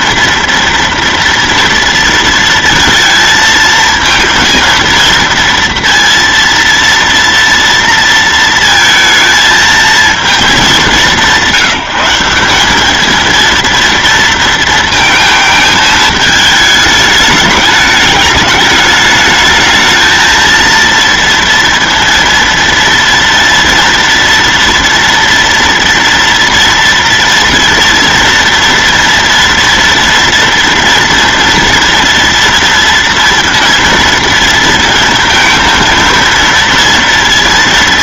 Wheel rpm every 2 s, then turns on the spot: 230, 230, 230, 230, 230, 200, 200, 230, 210, 210, 230, 230, 230, 230, 230, 230, 230, 230, 230.
none